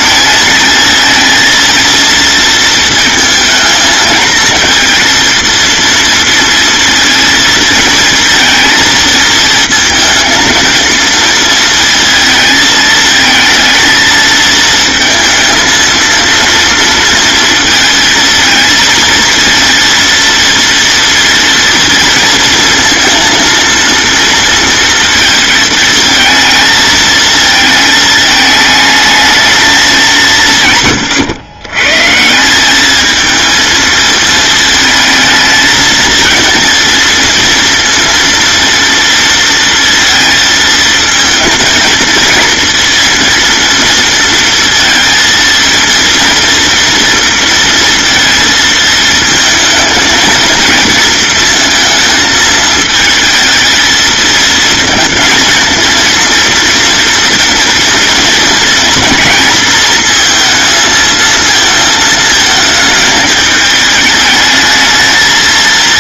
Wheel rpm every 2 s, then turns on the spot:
230, 230, 230, 230, 220, 230, 220, 230, 230, 220, 230, 230, 230, 220, 220, 130, 210, 220, 230, 230, 220, 230, 230, 230, 220, 230, 220, 230, 230, 230, 230, 220, 220.
none